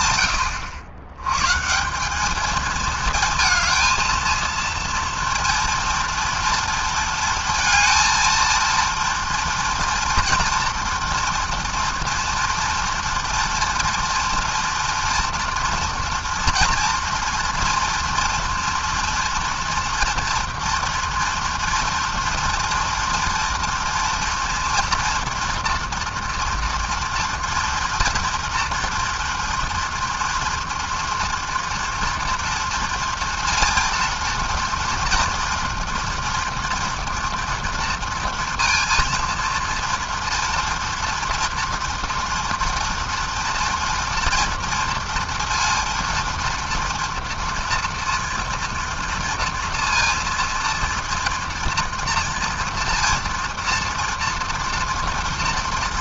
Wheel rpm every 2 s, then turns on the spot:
100, 220, 230, 230, 230, 240, 230, 240, 230, 230, 230, 230, 230, 230, 230, 230, 230, 230, 230, 230, 240, 240, 230, 230, 230, 230, 230, 230.
none